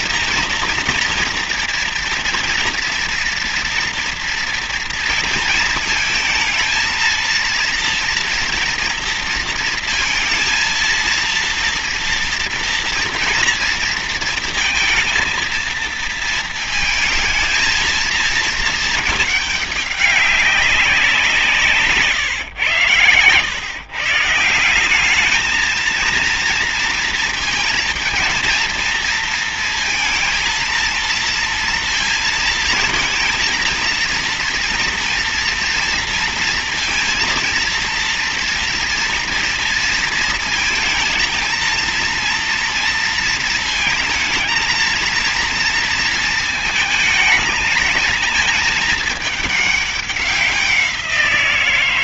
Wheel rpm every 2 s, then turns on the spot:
230, 240, 230, 220, 230, 230, 230, 230, 220, 220, 200, 130, 160, 230, 230, 230, 230, 230, 230, 230, 230, 230, 230, 230, 220, 190.
none